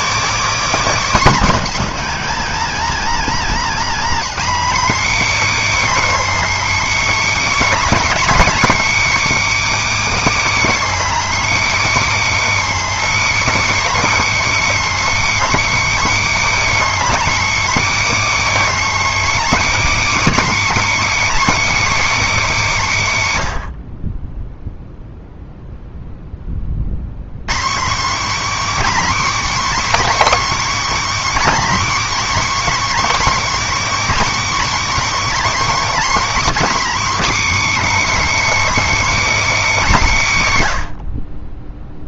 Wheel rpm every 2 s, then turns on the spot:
290, 280, 280, 320, 320, 320, 320, 320, 320, 320, 310, 240, 0, 50, 310, 320, 310, 310, 310, 320, 120.
none